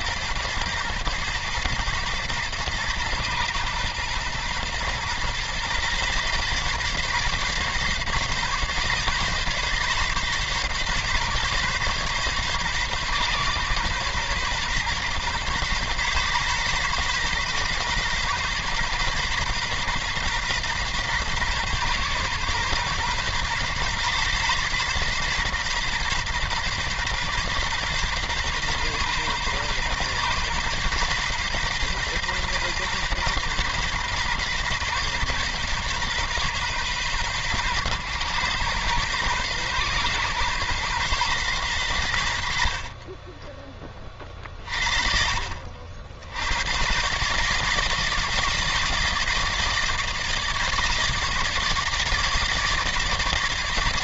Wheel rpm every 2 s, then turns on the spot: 120, 110, 110, 140, 140, 140, 130, 130, 120, 130, 130, 130, 130, 130, 130, 130, 130, 130, 130, 120, 120, 60, 40, 130, 160, 160, 160.
42-44